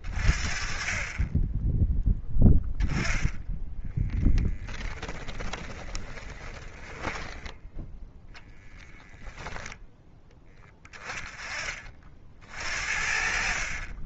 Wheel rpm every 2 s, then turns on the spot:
30, 10, 10, 20, 10, 30, 60.
4-10